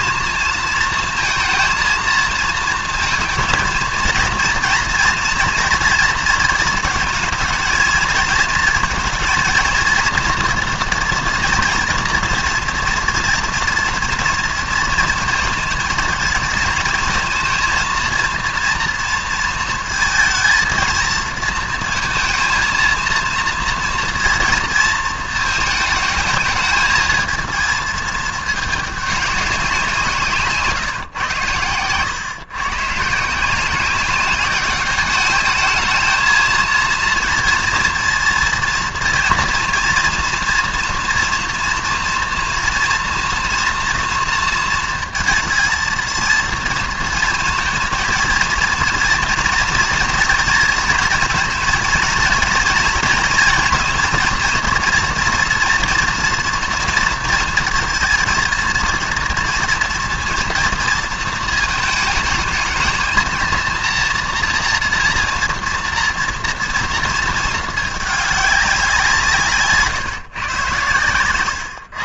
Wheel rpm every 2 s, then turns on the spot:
230, 230, 230, 230, 230, 240, 230, 230, 220, 230, 230, 230, 230, 220, 210, 150, 130, 200, 230, 230, 230, 230, 230, 230, 230, 230, 230, 230, 230, 230, 230, 220, 230, 230, 200, 130.
30-32